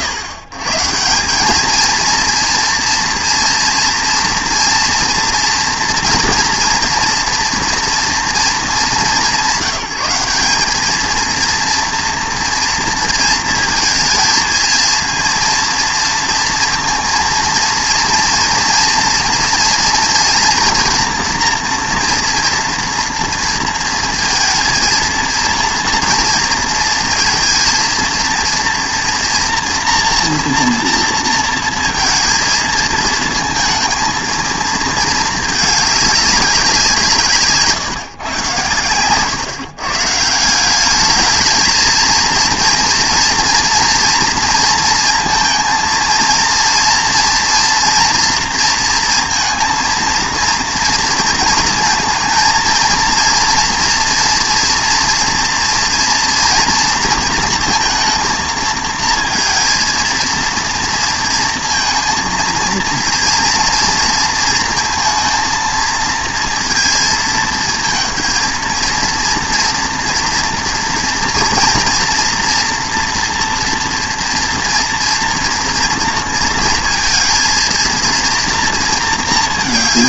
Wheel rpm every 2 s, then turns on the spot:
130, 240, 230, 230, 200, 210, 230, 230, 230, 230, 230, 230, 230, 230, 230, 230, 230, 220, 180, 110, 180, 230, 230, 230, 230, 230, 230, 230, 230, 230, 230, 230, 230, 230, 230, 230, 230, 230, 230, 230.
none